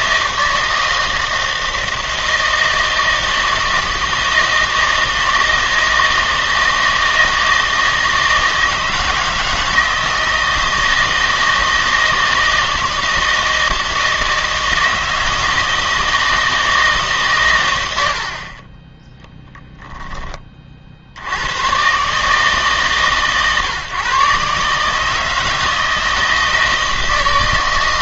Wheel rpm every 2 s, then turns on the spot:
160, 160, 160, 160, 160, 160, 160, 160, 160, 20, 40, 140, 140, 160.
none